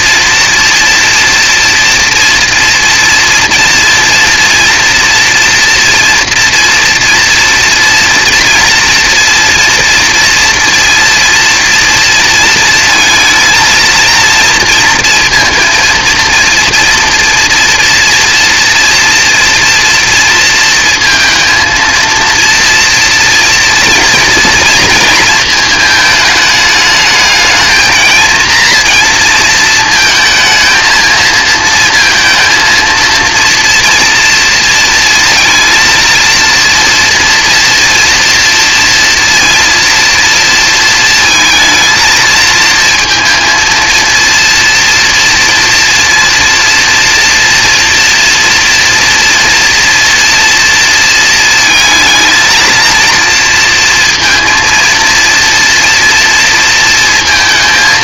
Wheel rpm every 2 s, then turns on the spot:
230, 230, 230, 230, 230, 230, 230, 230, 230, 230, 230, 230, 230, 210, 230, 220, 230, 230, 230, 230, 230, 230, 230, 230, 230, 230, 230, 230, 230.
none